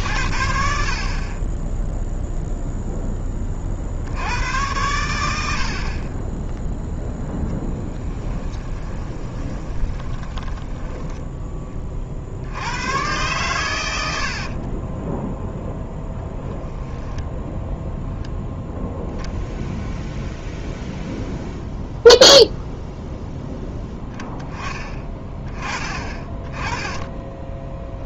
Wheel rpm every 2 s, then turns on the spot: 50, 0, 100, 0, 20, 20, 100, 20, 10, 0, 0, 0, 20, 20.
8-12 14-16